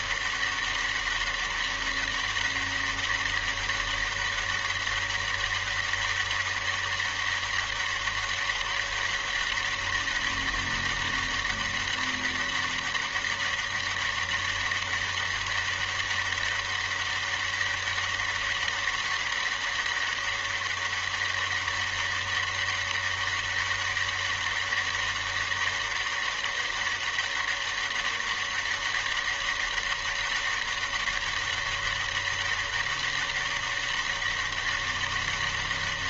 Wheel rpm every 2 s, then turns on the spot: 200, 200, 200, 200, 200, 200, 200, 200, 200, 200, 200, 200, 200, 200, 200, 200, 200, 200.
none